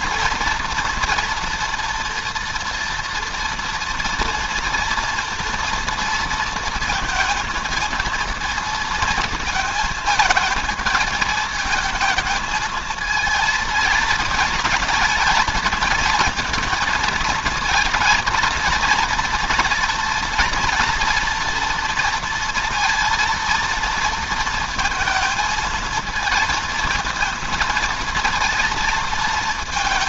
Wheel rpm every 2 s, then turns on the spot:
230, 240, 230, 230, 230, 220, 220, 220, 220, 220, 230, 230, 230, 230, 230.
none